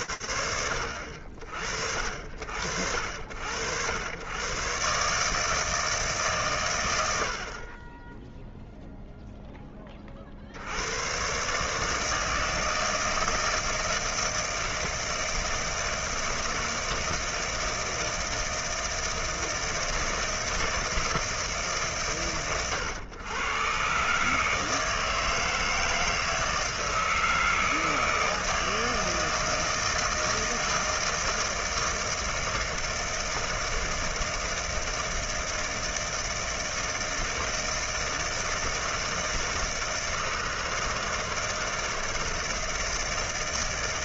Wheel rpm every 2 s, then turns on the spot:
60, 130, 120, 0, 50, 160, 160, 160, 160, 160, 140, 130, 160, 160, 160, 160, 160, 160, 160, 160, 160, 160.
none